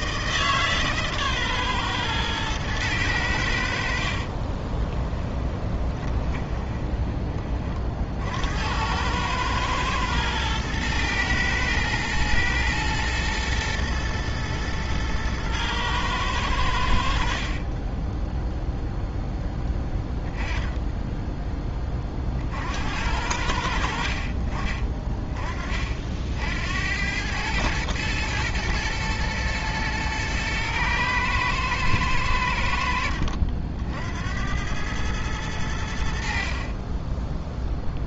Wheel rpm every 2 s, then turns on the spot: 150, 110, 30, 20, 90, 110, 110, 110, 90, 0, 10, 60, 40, 80, 110, 110, 80, 100, 40.
4-8